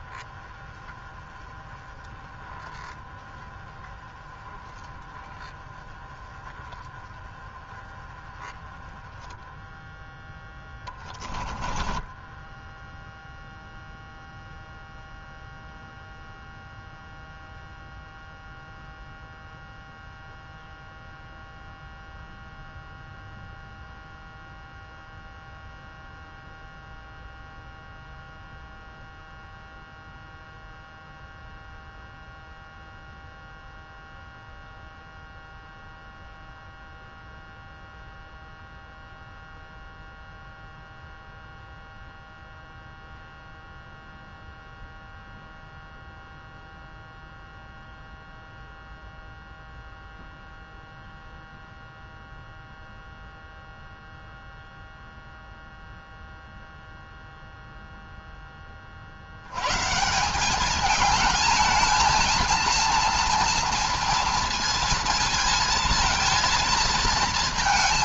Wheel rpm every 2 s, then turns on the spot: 20, 10, 20, 20, 10, 10, 10, 0, 0, 0, 0, 0, 0, 0, 0, 0, 0, 0, 0, 0, 0, 0, 0, 0, 0, 0, 0, 0, 0, 10, 190, 230, 230, 230.
10-14